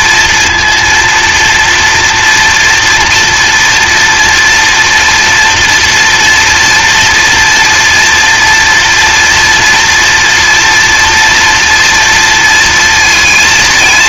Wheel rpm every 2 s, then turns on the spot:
230, 230, 230, 240, 230, 240, 230.
none